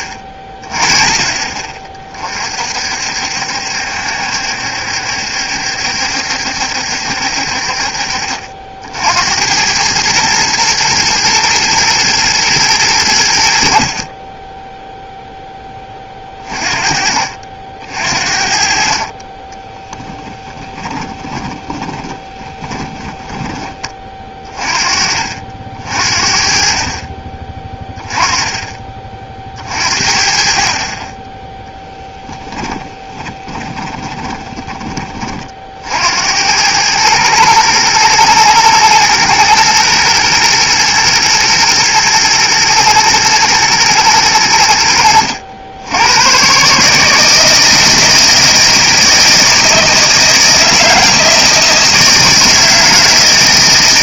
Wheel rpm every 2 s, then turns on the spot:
40, 70, 70, 50, 110, 120, 30, 20, 50, 20, 20, 20, 50, 20, 50, 10, 20, 50, 110, 110, 120, 120, 80, 160, 160, 160, 160.
18-22 32-34